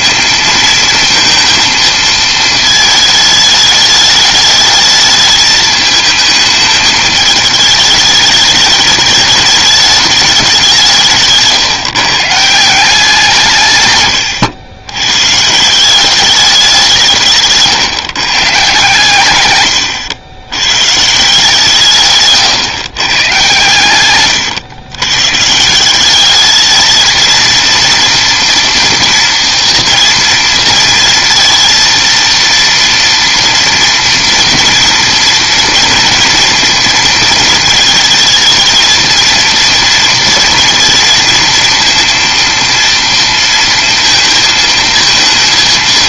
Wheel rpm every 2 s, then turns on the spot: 230, 220, 210, 220, 210, 190, 160, 110, 190, 140, 110, 150, 120, 210, 230, 230, 230, 230, 230, 220, 230, 230, 230.
none